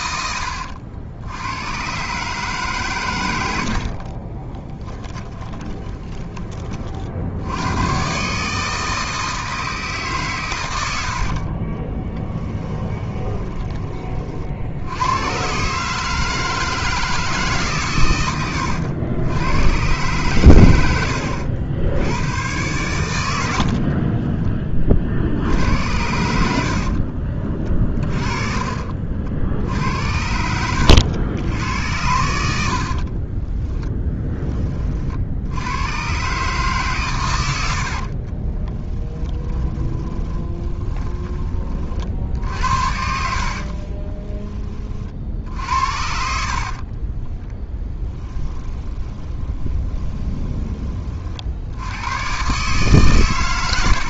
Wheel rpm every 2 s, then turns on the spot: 80, 130, 10, 40, 160, 110, 10, 80, 160, 90, 90, 100, 30, 50, 40, 80, 60, 30, 140, 20, 20, 60, 30, 40, 20, 20, 140.
4-6 12-14 20-22 26-34 38-44 46-50